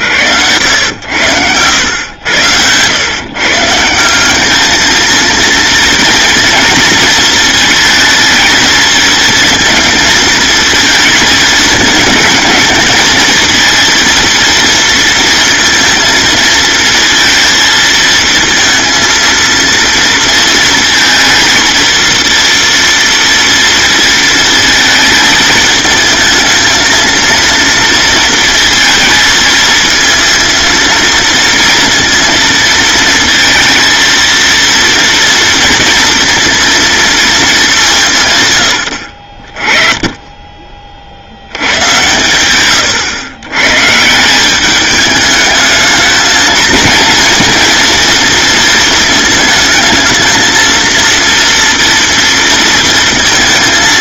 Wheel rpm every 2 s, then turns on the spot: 80, 110, 220, 230, 230, 220, 220, 230, 230, 230, 230, 230, 220, 230, 220, 230, 230, 230, 230, 90, 30, 110, 210, 230, 220, 230, 230.
none